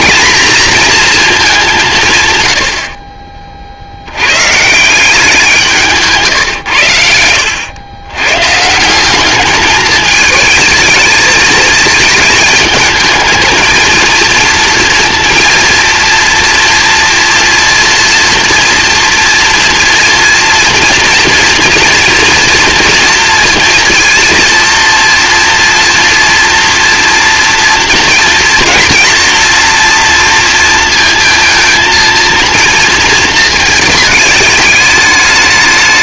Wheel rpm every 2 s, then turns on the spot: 230, 40, 150, 100, 160, 220, 220, 230, 230, 230, 230, 230, 230, 230, 240, 230, 230, 210.
none